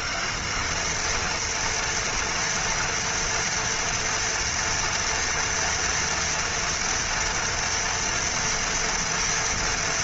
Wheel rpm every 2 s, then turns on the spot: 160, 240, 230, 230, 230.
none